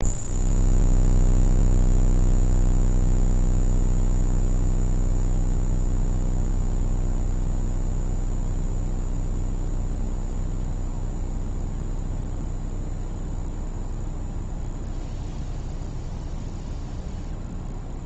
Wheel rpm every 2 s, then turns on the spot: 0, 0, 0, 0, 0, 0, 0, 0, 0.
none